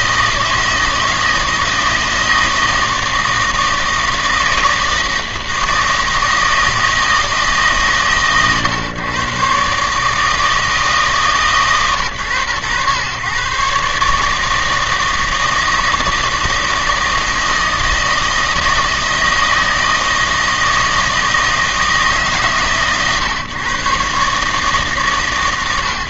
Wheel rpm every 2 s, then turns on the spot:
160, 160, 160, 160, 130, 160, 130, 160, 160, 160, 160, 140, 150.
none